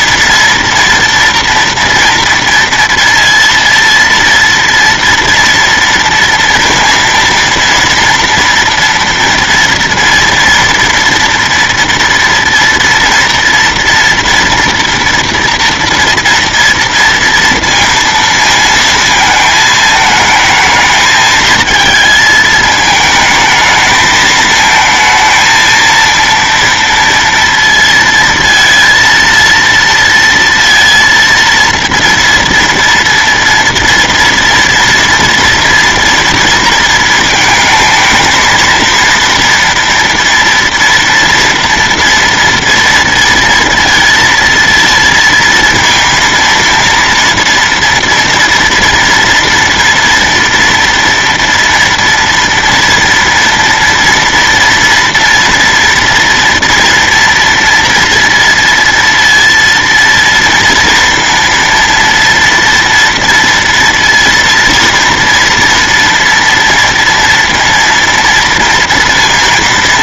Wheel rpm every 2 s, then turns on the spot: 240, 230, 230, 230, 230, 230, 230, 240, 230, 230, 220, 220, 220, 230, 230, 230, 230, 230, 230, 230, 230, 230, 230, 230, 230, 230, 230, 240, 230, 230, 230, 230, 230, 230, 230.
none